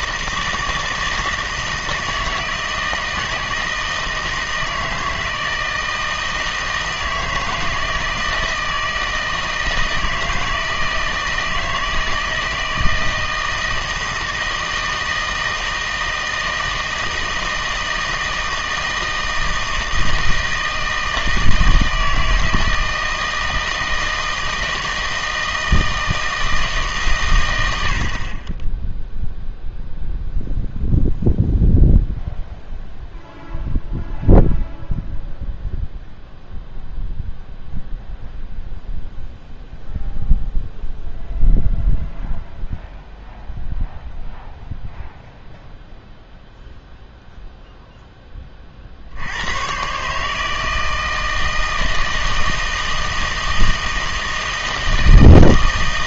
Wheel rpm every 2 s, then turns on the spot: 160, 160, 160, 160, 160, 160, 160, 160, 160, 160, 160, 160, 160, 160, 10, 0, 0, 0, 0, 0, 0, 0, 0, 0, 40, 160, 160, 160.
none